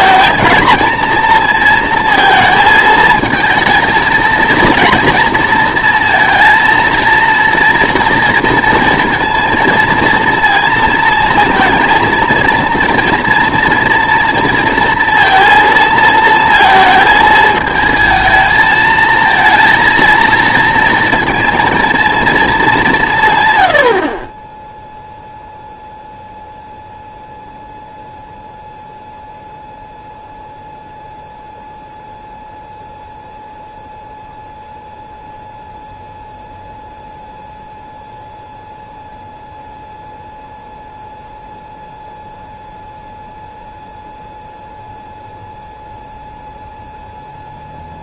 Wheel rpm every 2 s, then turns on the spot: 230, 220, 230, 230, 230, 230, 230, 230, 220, 220, 230, 210, 0, 0, 0, 0, 0, 0, 0, 0, 0, 0, 0, 0.
none